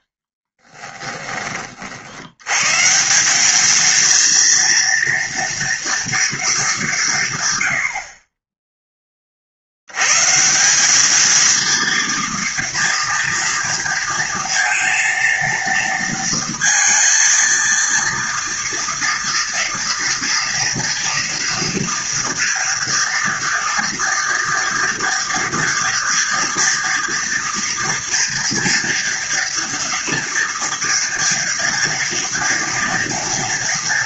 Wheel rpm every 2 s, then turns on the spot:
20, 110, 230, 220, 20, 170, 230, 230, 230, 230, 240, 230, 230, 230, 230, 240, 230.
0-2